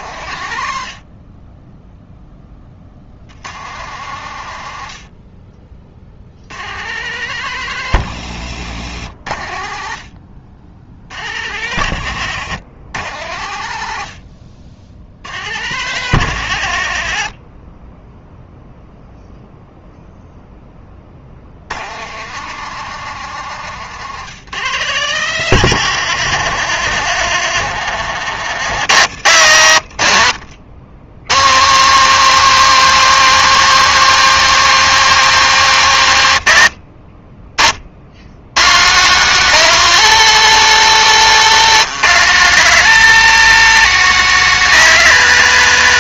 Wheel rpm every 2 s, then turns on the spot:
50, 70, 50, 130, 80, 80, 90, 80, 60, 0, 50, 150, 130, 110, 110, 110, 190, 180, 40, 160, 180, 190, 170.
40-42